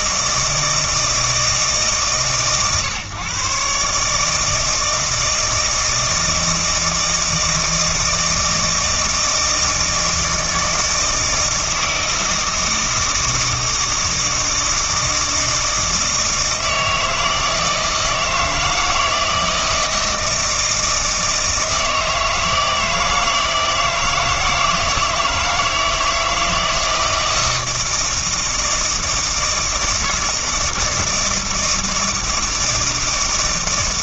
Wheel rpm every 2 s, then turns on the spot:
160, 130, 160, 160, 160, 160, 160, 160, 160, 160, 160, 160, 160, 160, 160, 160, 160.
none